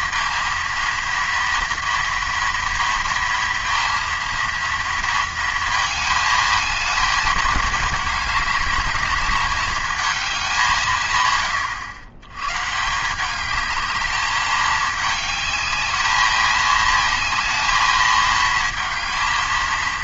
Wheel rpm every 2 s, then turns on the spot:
230, 230, 230, 220, 210, 190, 130, 210, 220, 220.
none